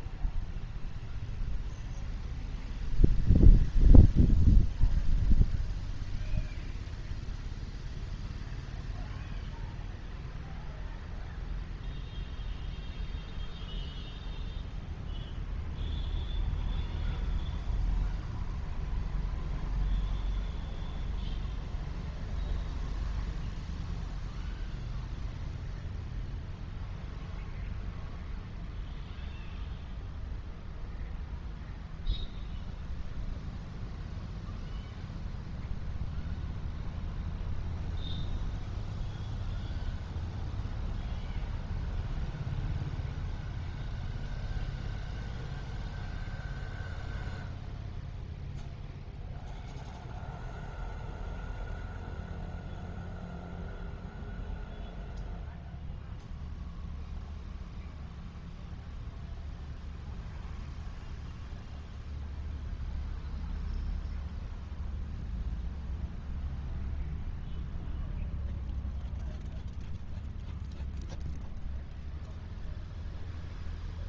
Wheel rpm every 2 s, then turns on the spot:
0, 0, 0, 0, 0, 0, 0, 0, 0, 0, 0, 0, 0, 0, 0, 0, 0, 0, 0, 0, 0, 0, 0, 0, 0, 0, 0, 0, 0, 0, 0, 0, 0, 0, 0, 0, 0.
none